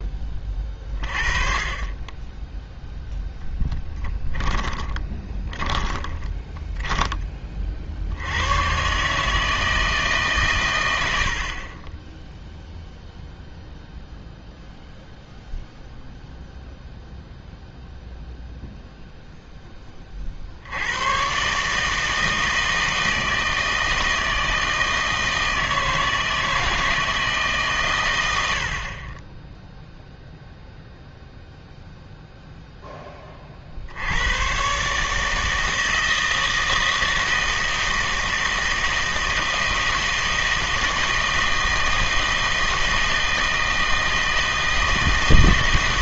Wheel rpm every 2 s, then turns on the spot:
20, 10, 20, 10, 100, 120, 0, 0, 0, 0, 60, 160, 160, 160, 80, 0, 0, 120, 160, 160, 160, 160, 160.
4-8